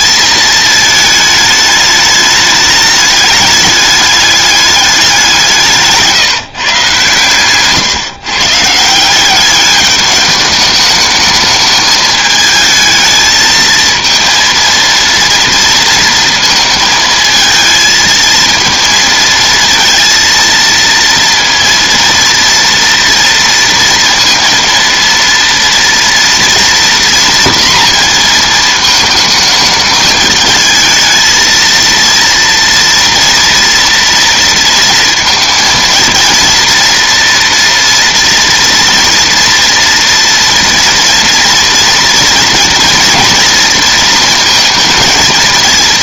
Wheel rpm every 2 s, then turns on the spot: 220, 210, 200, 150, 150, 210, 220, 230, 230, 230, 230, 230, 230, 230, 220, 220, 230, 230, 240, 230, 230, 230, 220.
none